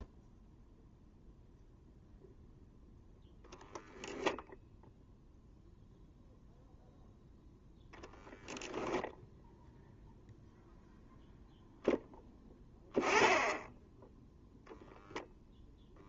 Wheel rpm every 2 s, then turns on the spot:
0, 0, 0, 0, 0, 0, 10, 0.
none